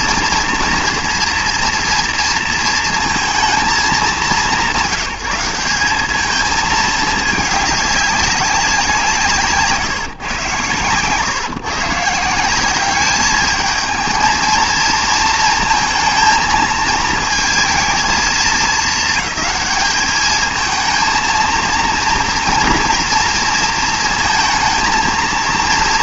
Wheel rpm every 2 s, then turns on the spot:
230, 230, 170, 220, 180, 130, 200, 230, 220, 220, 230, 240, 220.
none